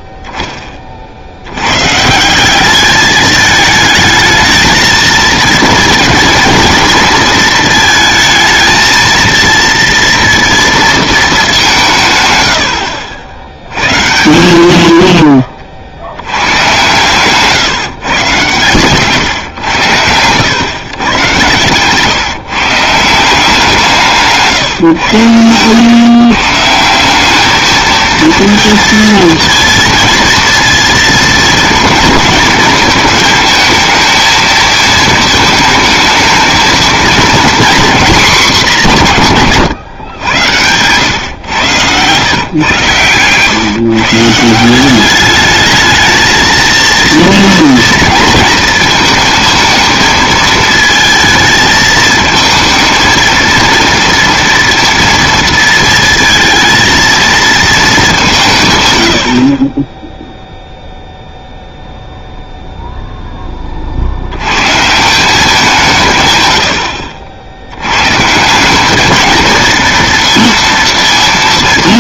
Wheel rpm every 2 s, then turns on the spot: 10, 190, 220, 230, 220, 230, 100, 110, 130, 130, 130, 160, 140, 180, 230, 230, 210, 220, 230, 190, 110, 130, 190, 230, 230, 220, 220, 230, 230, 100, 0, 0, 140, 80, 200, 230.
12-14 58-60